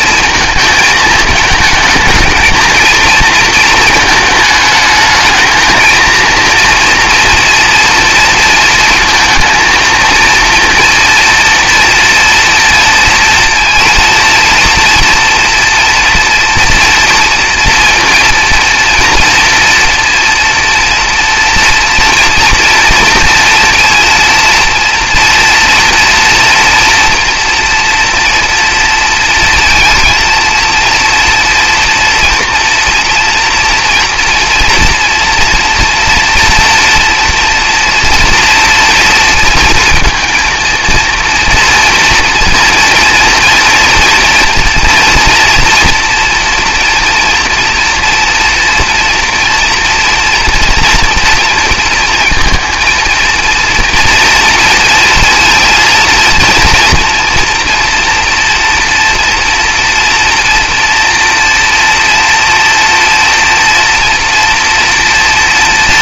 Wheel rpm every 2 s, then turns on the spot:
220, 230, 220, 230, 230, 230, 230, 230, 230, 230, 230, 230, 230, 230, 230, 230, 230, 240, 230, 230, 230, 240, 230, 230, 240, 230, 230, 240, 230, 240, 230, 230, 230.
none